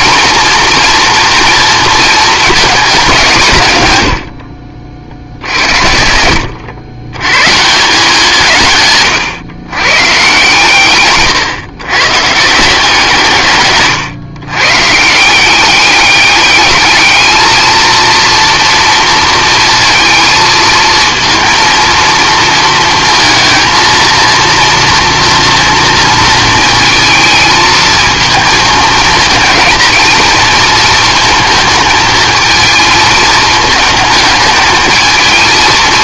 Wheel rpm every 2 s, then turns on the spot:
230, 220, 70, 90, 150, 140, 160, 130, 210, 230, 230, 230, 230, 230, 220, 230, 230, 220.
none